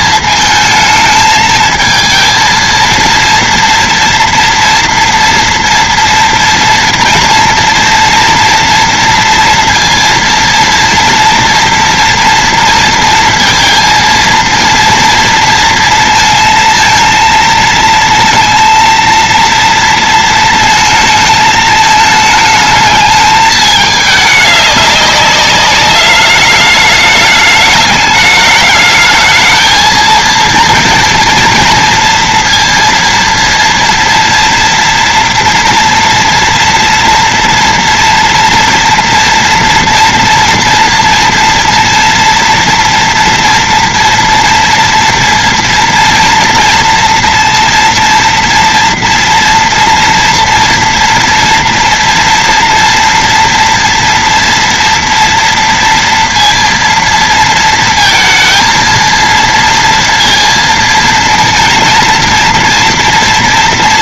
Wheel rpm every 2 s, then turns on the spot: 220, 230, 230, 240, 230, 230, 230, 230, 230, 230, 230, 210, 210, 210, 210, 230, 230, 230, 230, 230, 230, 230, 230, 230, 230, 240, 230, 230, 230, 230, 230, 230.
none